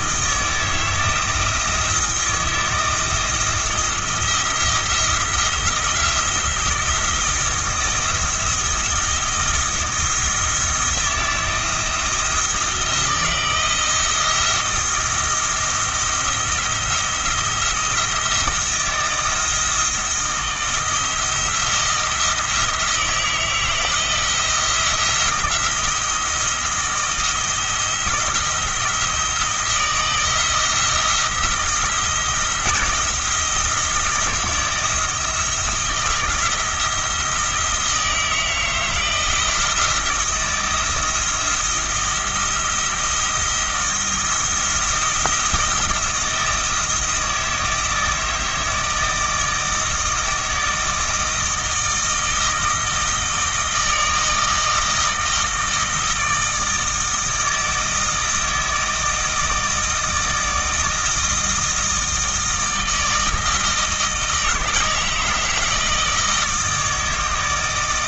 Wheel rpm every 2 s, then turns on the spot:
160, 160, 170, 170, 170, 170, 170, 170, 170, 160, 170, 160, 170, 160, 170, 170, 170, 170, 170, 160, 160, 170, 170, 160, 160, 160, 160, 160, 160, 160, 160, 160, 160, 160.
none